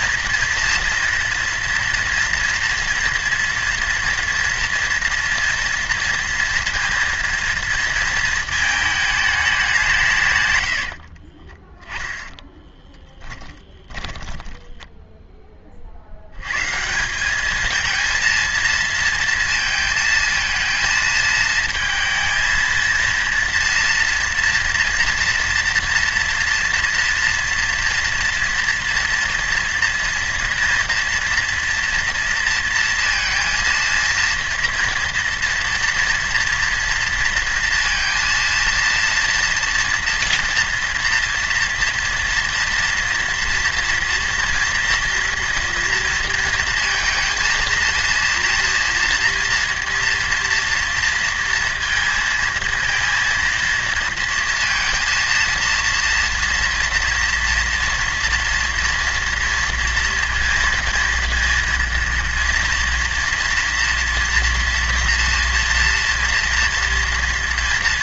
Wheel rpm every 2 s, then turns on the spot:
230, 240, 230, 230, 220, 110, 10, 20, 120, 230, 220, 230, 230, 230, 230, 230, 230, 240, 230, 230, 230, 240, 230, 230, 230, 230, 230, 230, 240, 230, 230, 240, 230, 230.
12-16